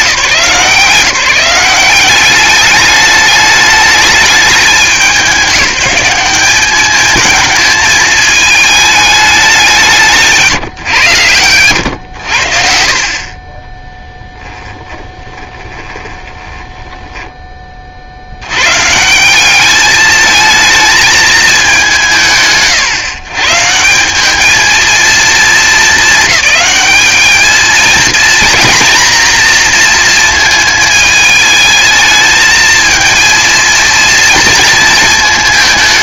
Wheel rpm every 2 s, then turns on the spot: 170, 210, 190, 210, 210, 160, 60, 20, 10, 140, 220, 140, 220, 210, 240, 220, 220, 220.
14-18